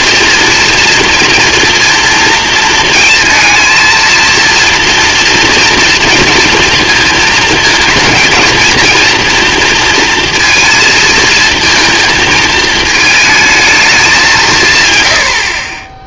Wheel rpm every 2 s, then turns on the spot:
230, 220, 230, 220, 230, 220, 220, 140.
none